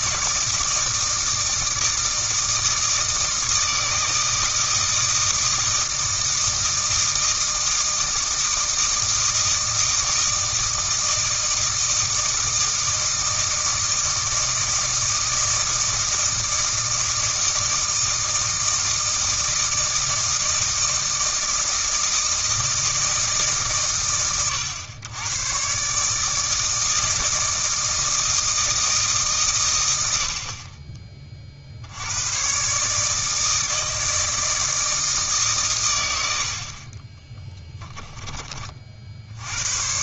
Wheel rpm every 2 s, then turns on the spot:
160, 160, 160, 160, 160, 160, 160, 160, 160, 160, 160, 160, 110, 160, 160, 40, 140, 160, 50, 40.
none